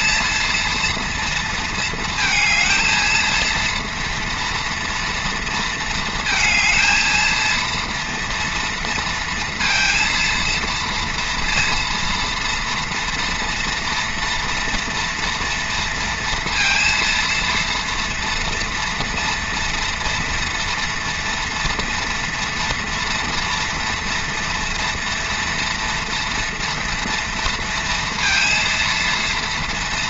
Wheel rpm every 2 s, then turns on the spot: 230, 230, 230, 230, 230, 230, 230, 240, 230, 230, 240, 230, 240, 230, 230.
none